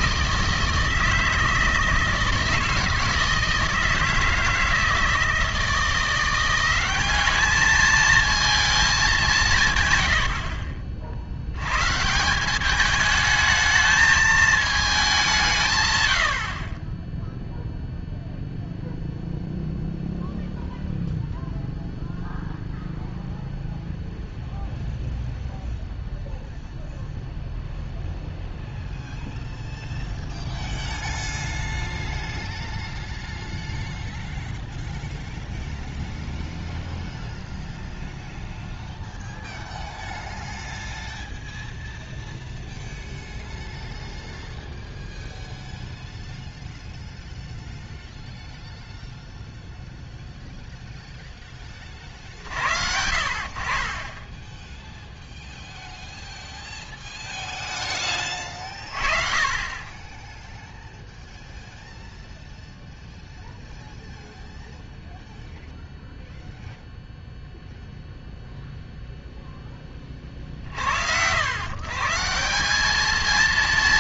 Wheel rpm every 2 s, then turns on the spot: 160, 160, 160, 190, 220, 60, 200, 210, 30, 0, 0, 0, 0, 0, 0, 0, 0, 0, 0, 0, 0, 0, 0, 0, 0, 0, 70, 0, 0, 40, 0, 0, 0, 0, 0, 50, 200.
none